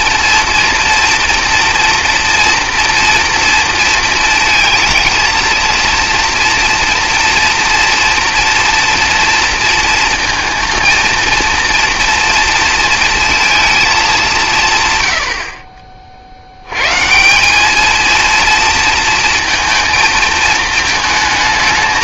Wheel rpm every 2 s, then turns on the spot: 240, 230, 220, 230, 230, 230, 230, 160, 90, 230, 220.
none